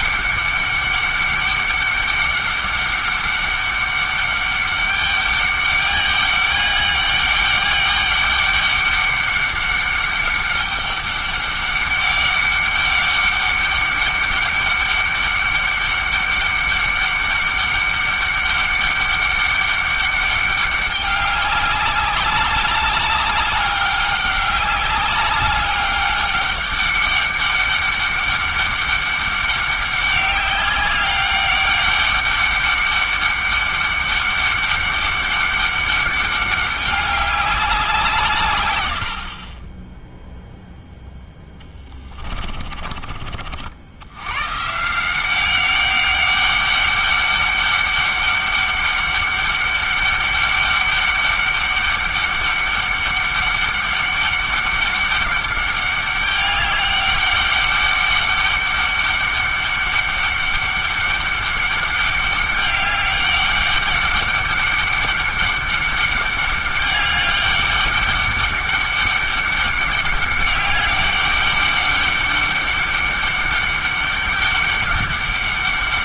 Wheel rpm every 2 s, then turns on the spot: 200, 200, 200, 200, 200, 200, 200, 200, 200, 200, 200, 200, 200, 200, 200, 200, 200, 200, 200, 110, 0, 30, 140, 200, 200, 200, 200, 200, 200, 200, 200, 200, 200, 200, 200, 200, 200, 200.
42-44